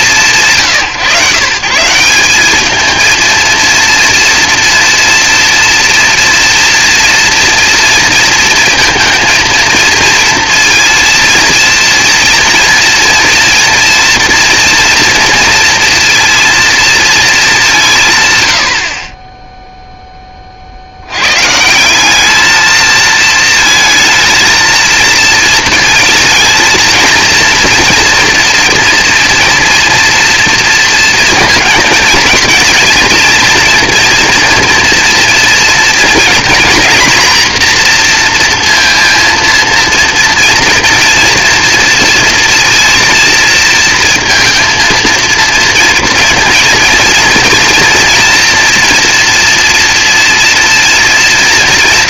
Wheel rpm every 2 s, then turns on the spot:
130, 230, 230, 240, 230, 230, 230, 230, 220, 30, 80, 220, 230, 230, 230, 230, 230, 240, 240, 230, 230, 230, 220, 230, 230, 230.
none